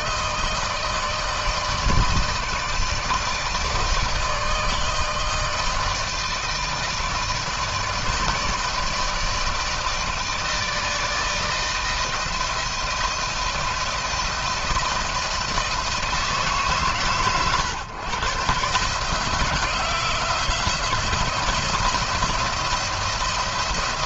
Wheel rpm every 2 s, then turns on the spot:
160, 160, 160, 160, 160, 160, 160, 160, 150, 140, 170, 170.
none